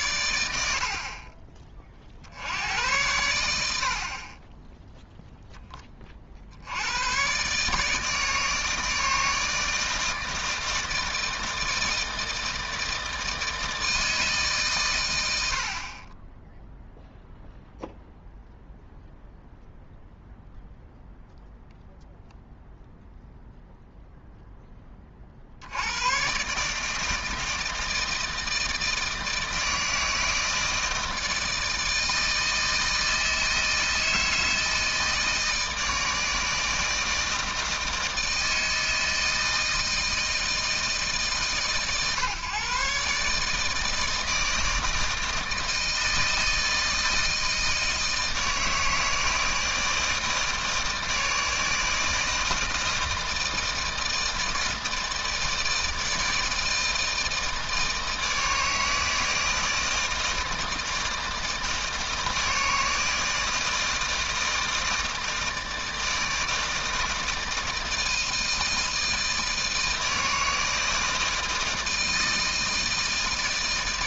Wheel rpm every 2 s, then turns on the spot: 50, 90, 0, 90, 150, 160, 160, 120, 0, 0, 0, 0, 20, 150, 160, 160, 160, 160, 160, 160, 150, 140, 160, 160, 160, 160, 160, 160, 160, 160, 160, 160, 160, 160, 160, 160, 160.
none